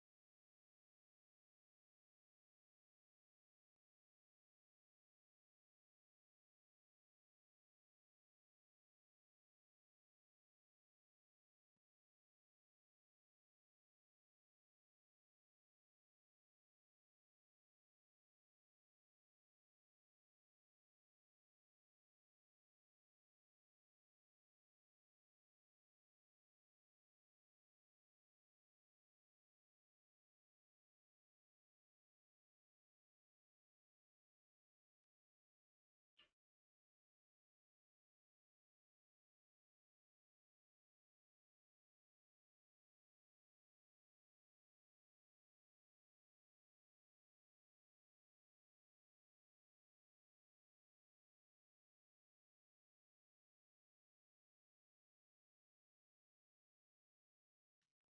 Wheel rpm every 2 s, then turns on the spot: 0, 0, 0, 0, 0, 0, 0, 0, 0, 0, 0, 0, 0, 0, 0, 0, 0, 0, 0, 0, 0, 0, 0, 0, 0, 0, 0, 0, 0.
none